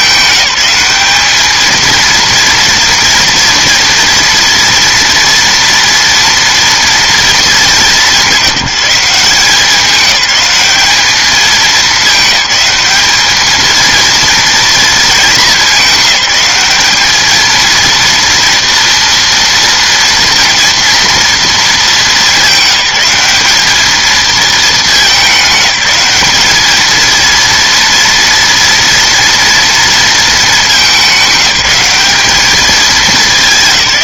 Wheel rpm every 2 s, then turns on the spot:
200, 230, 230, 230, 190, 200, 210, 230, 200, 230, 230, 210, 220, 210, 230, 220, 210.
none